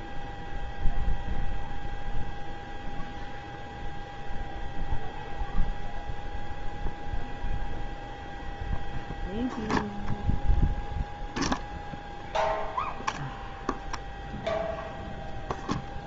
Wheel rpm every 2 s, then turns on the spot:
0, 0, 0, 0, 0, 0, 0, 0.
none